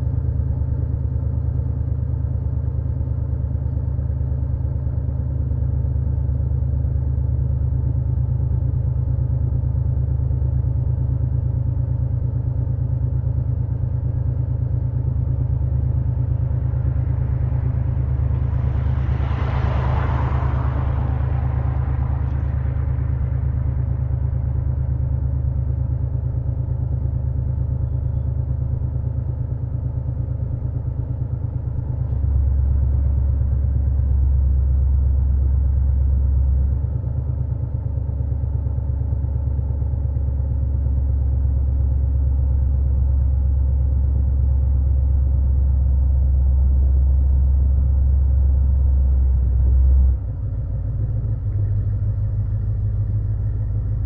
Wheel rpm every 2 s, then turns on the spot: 0, 0, 0, 0, 0, 0, 0, 0, 0, 0, 0, 0, 0, 0, 0, 0, 0, 0, 0, 0, 0, 0, 0, 0, 0, 0, 0.
none